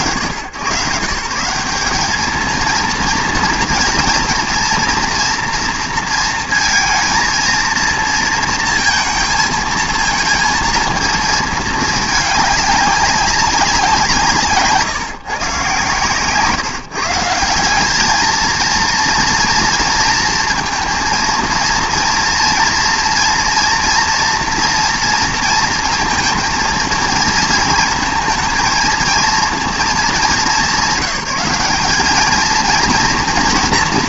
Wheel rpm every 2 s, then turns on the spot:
120, 230, 230, 230, 230, 230, 200, 160, 160, 230, 220, 230, 230, 230, 220, 190, 230.
none